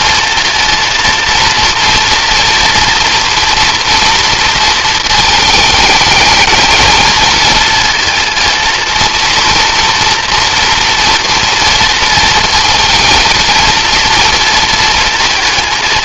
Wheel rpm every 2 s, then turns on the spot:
230, 230, 220, 220, 230, 230, 230, 230.
none